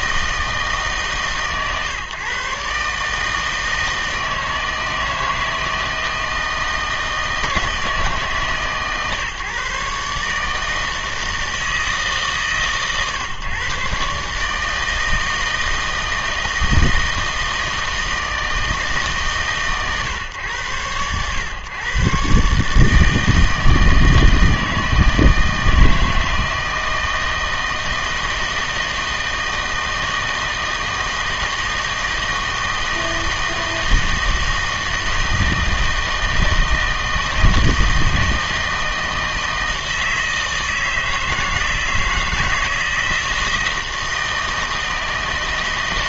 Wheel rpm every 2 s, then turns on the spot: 150, 140, 160, 160, 140, 160, 140, 160, 160, 160, 110, 150, 160, 160, 160, 160, 160, 160, 160, 160, 160, 160, 160.
none